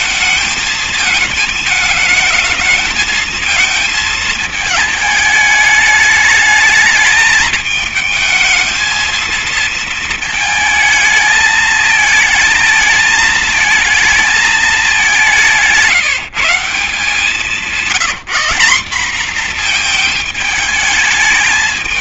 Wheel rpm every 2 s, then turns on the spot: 220, 220, 210, 220, 220, 220, 220, 190, 170, 220, 210.
none